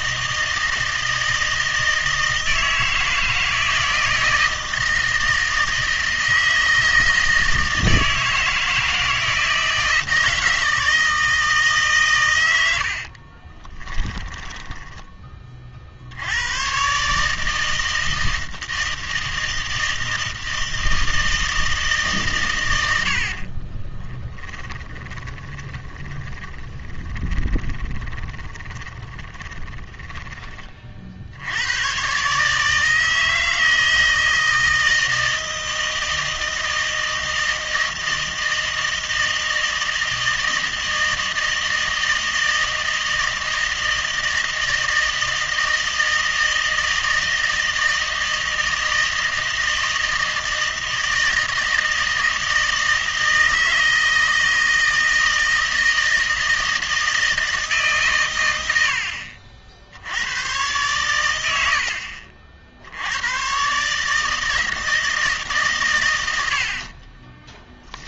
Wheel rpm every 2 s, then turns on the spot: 160, 160, 160, 160, 160, 160, 80, 10, 110, 160, 160, 120, 20, 10, 30, 30, 150, 160, 160, 160, 160, 160, 160, 160, 160, 160, 160, 160, 160, 90, 120, 70, 160, 40.
14-16 24-30